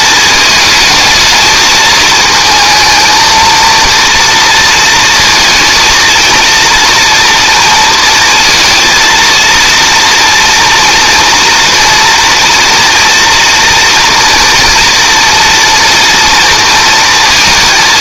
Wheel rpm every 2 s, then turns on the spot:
220, 220, 230, 230, 230, 230, 230, 240, 230.
none